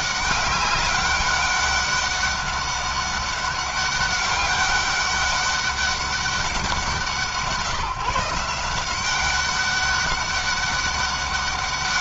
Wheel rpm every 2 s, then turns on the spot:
200, 200, 200, 180, 180, 200.
none